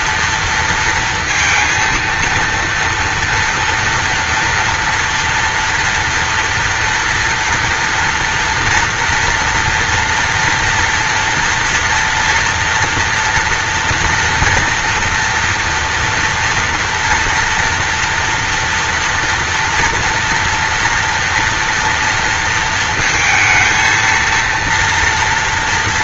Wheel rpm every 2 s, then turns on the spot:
230, 230, 240, 230, 230, 240, 230, 230, 230, 230, 230, 230, 230.
none